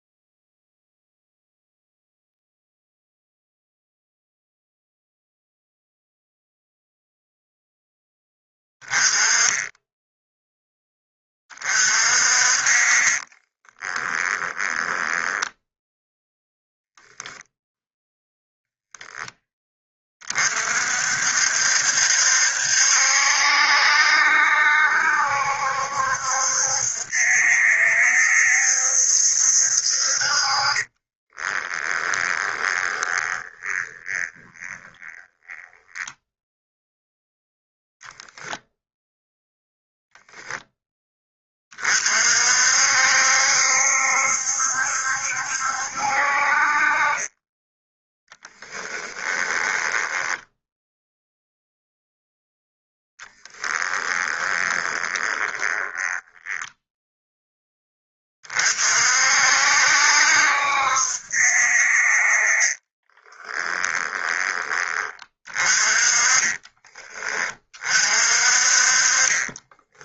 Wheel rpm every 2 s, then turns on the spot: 0, 0, 0, 0, 20, 10, 40, 10, 0, 10, 50, 70, 70, 70, 70, 30, 20, 20, 0, 0, 10, 60, 70, 40, 10, 0, 0, 20, 10, 50, 70, 30, 30, 30, 40.
12-16 30-36 48-50 54-56 62-64